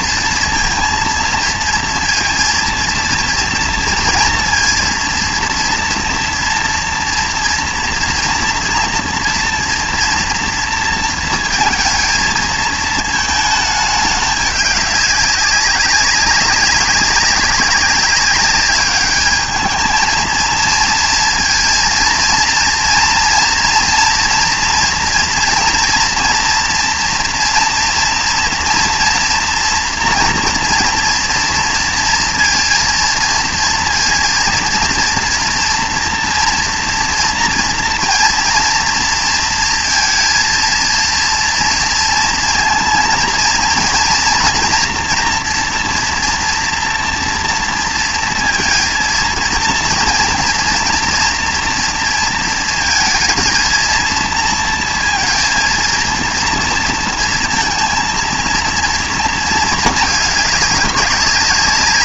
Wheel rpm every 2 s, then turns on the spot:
230, 230, 240, 240, 230, 230, 220, 200, 200, 200, 230, 230, 240, 230, 240, 230, 230, 230, 240, 230, 230, 230, 230, 240, 230, 230, 230, 230, 230, 230, 210.
none